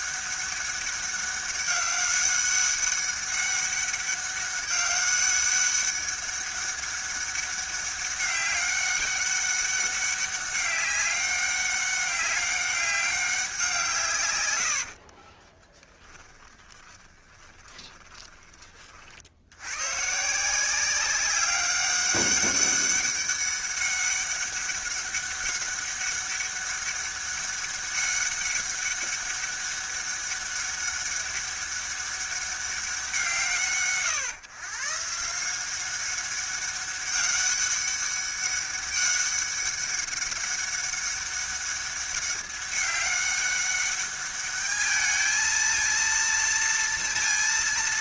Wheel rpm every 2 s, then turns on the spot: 200, 200, 200, 200, 200, 200, 200, 100, 20, 20, 170, 200, 200, 200, 200, 200, 200, 140, 200, 200, 200, 200, 210, 230.
14-18